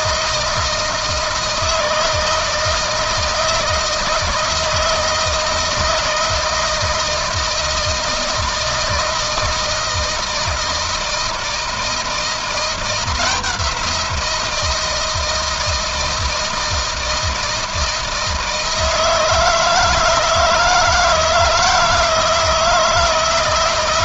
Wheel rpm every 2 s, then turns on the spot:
160, 160, 160, 160, 160, 160, 170, 160, 160, 160, 160, 160.
none